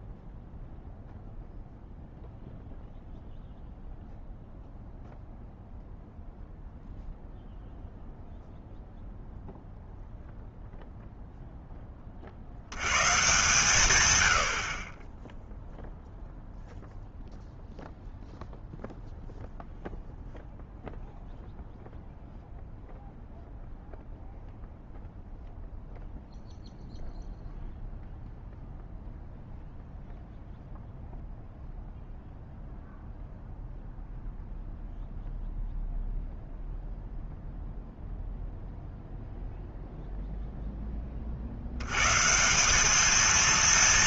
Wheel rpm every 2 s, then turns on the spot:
0, 0, 0, 0, 0, 0, 80, 70, 0, 0, 0, 0, 0, 0, 0, 0, 0, 0, 0, 0, 0, 180.
none